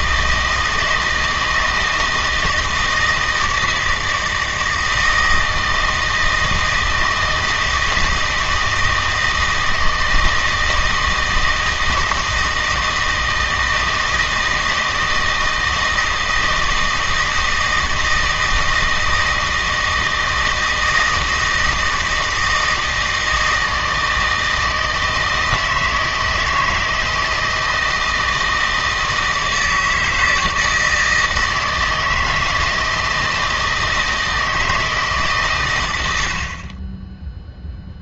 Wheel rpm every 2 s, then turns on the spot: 160, 160, 160, 160, 160, 160, 160, 160, 160, 160, 160, 160, 160, 160, 160, 160, 160, 160, 30.
none